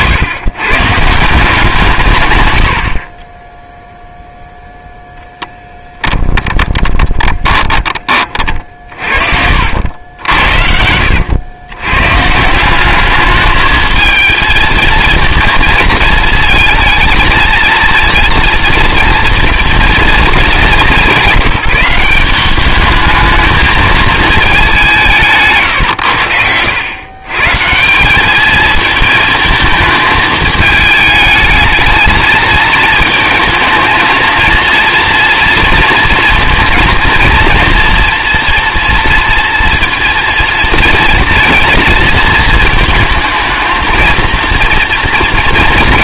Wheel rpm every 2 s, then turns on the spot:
120, 30, 0, 20, 40, 70, 180, 220, 230, 230, 210, 200, 200, 90, 220, 210, 220, 230, 230, 230, 230, 230, 230.
2-4 6-10